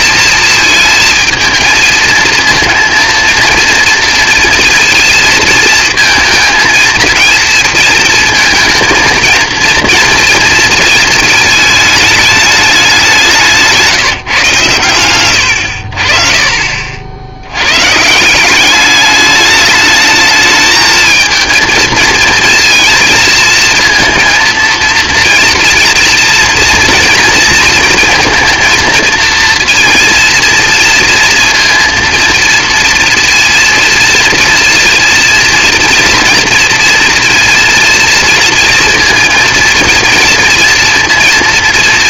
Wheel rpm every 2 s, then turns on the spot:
220, 230, 230, 230, 230, 230, 200, 140, 50, 200, 220, 230, 230, 230, 230, 230, 230, 230, 230, 230, 230.
none